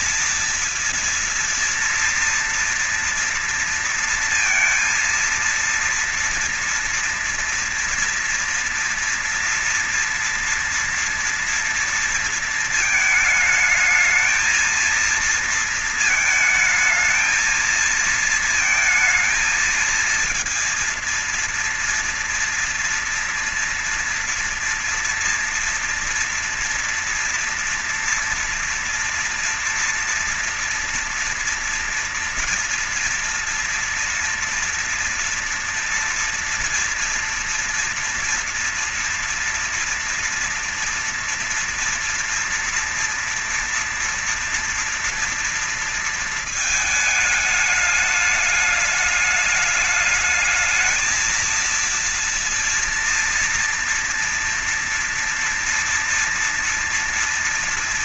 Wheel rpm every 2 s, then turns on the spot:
230, 230, 230, 230, 230, 230, 230, 220, 220, 230, 230, 230, 230, 230, 230, 230, 230, 240, 230, 240, 230, 230, 240, 220, 210, 220, 230, 230, 230.
none